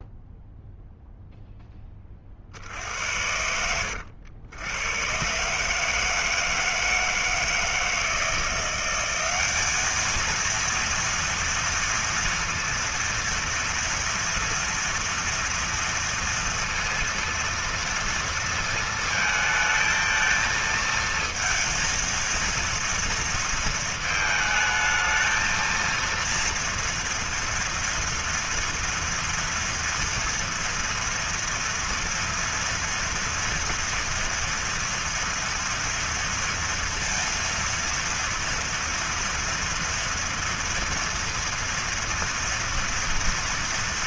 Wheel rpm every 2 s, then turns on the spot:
0, 70, 110, 160, 180, 230, 230, 230, 230, 230, 230, 230, 220, 240, 240, 230, 230, 230, 230, 230, 230, 230.
none